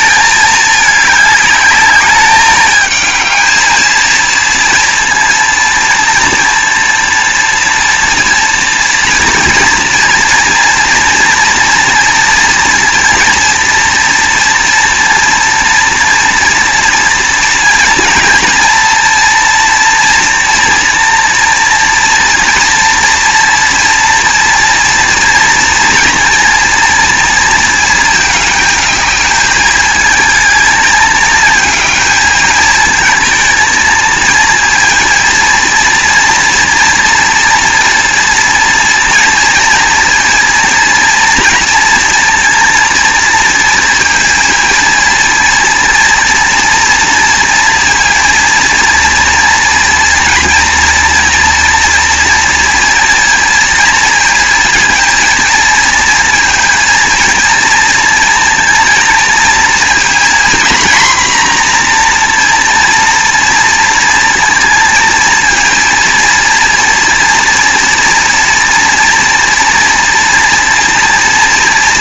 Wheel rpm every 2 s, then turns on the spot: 210, 210, 230, 230, 230, 230, 230, 230, 240, 230, 240, 230, 230, 230, 220, 220, 220, 230, 230, 230, 230, 230, 230, 230, 230, 230, 230, 230, 230, 230, 240, 240, 230, 230, 230, 230.
none